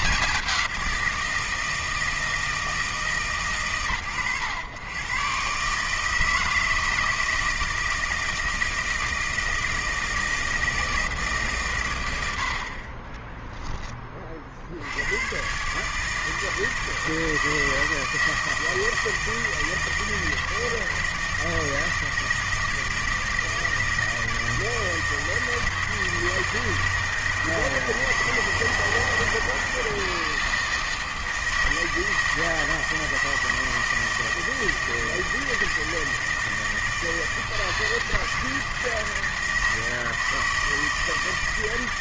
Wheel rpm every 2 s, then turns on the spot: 190, 160, 110, 160, 160, 160, 60, 60, 160, 160, 160, 160, 160, 160, 160, 160, 160, 160, 160, 160, 160.
none